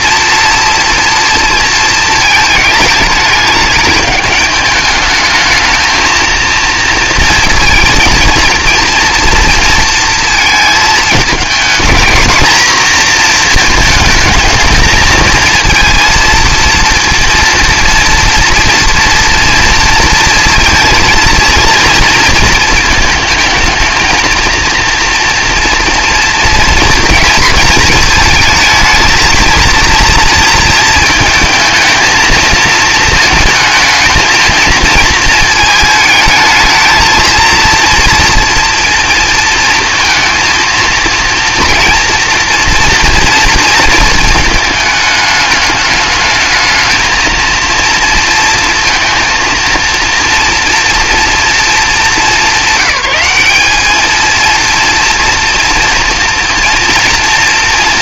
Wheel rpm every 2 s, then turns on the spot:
230, 220, 210, 230, 230, 220, 220, 220, 230, 230, 230, 230, 230, 230, 220, 230, 230, 230, 220, 230, 230, 230, 220, 220, 230, 240, 200, 230, 230.
none